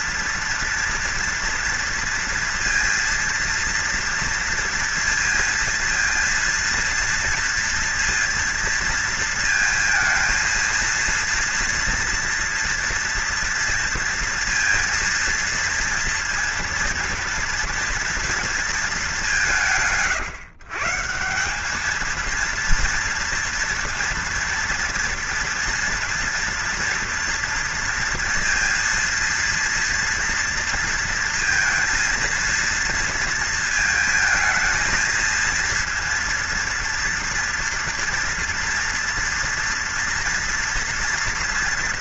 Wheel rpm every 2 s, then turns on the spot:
240, 230, 230, 230, 230, 230, 230, 230, 230, 220, 140, 230, 230, 230, 230, 230, 230, 220, 230, 230, 240.
none